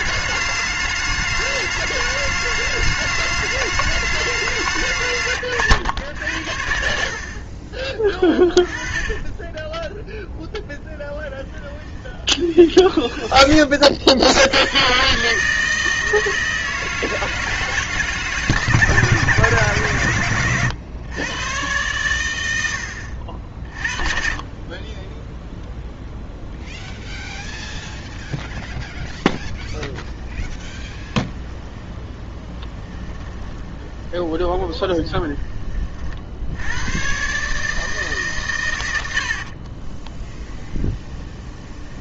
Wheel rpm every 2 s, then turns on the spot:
210, 210, 160, 60, 20, 0, 20, 120, 160, 150, 120, 70, 20, 10, 10, 20, 20, 20, 110, 100, 20.
12-14 26-28 30-36 40-42